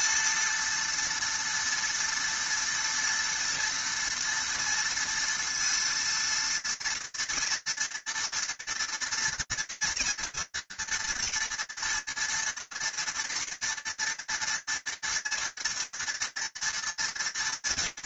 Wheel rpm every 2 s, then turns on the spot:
230, 240, 230, 230, 230, 240, 230, 230, 230.
none